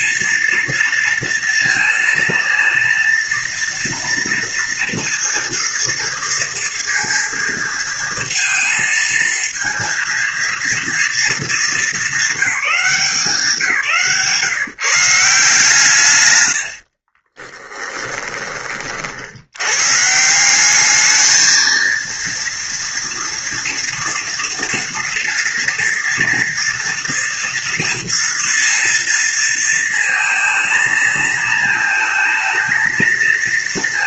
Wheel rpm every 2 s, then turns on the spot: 230, 230, 240, 230, 230, 230, 190, 150, 70, 30, 200, 230, 240, 230, 230, 230, 230.
16-18